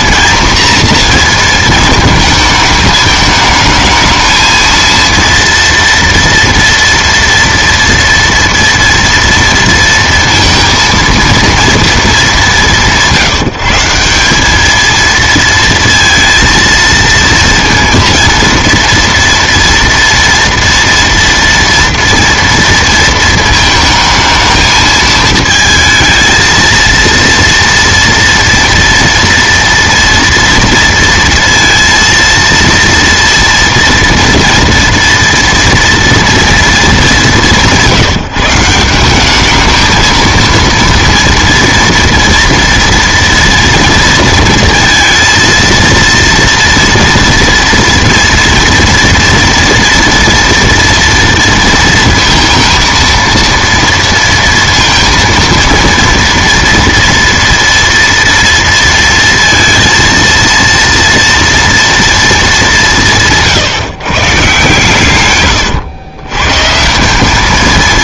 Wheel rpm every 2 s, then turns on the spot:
230, 220, 230, 230, 230, 230, 180, 210, 230, 230, 230, 230, 220, 230, 230, 230, 230, 230, 230, 160, 230, 230, 230, 230, 230, 230, 230, 230, 230, 230, 230, 200, 140, 140.
none